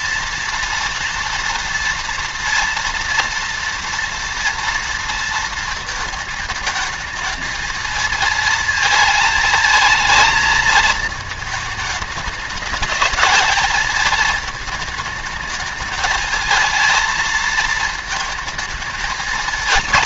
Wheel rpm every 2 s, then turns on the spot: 230, 230, 230, 220, 230, 220, 210, 220, 220, 220.
none